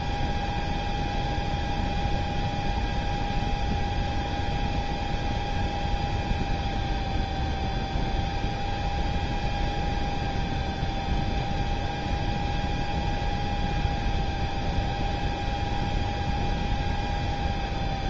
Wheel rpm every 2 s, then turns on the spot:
0, 0, 0, 0, 0, 0, 0, 0, 0.
none